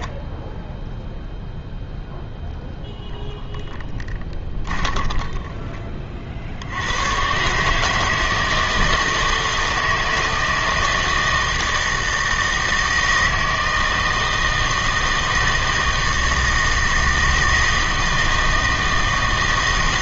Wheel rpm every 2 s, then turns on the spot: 10, 0, 20, 70, 160, 160, 160, 160, 160, 160.
4-6